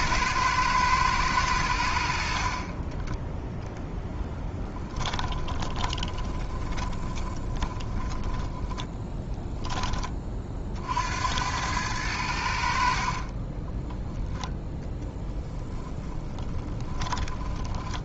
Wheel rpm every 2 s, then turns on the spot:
120, 20, 10, 10, 10, 60, 50, 10, 30.
4-10 12-18